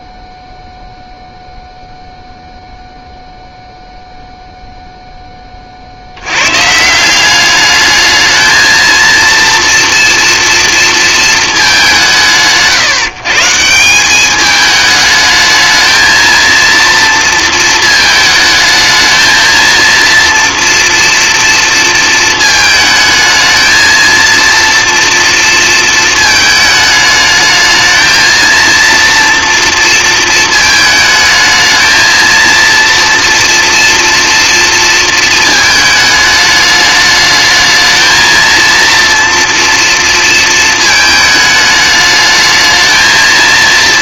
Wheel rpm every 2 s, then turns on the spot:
0, 0, 0, 150, 230, 230, 160, 210, 230, 220, 230, 220, 230, 220, 230, 220, 230, 230, 210, 240, 220, 220.
none